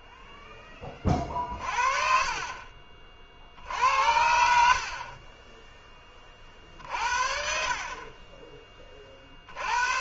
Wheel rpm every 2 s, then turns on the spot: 20, 30, 70, 50, 10.
none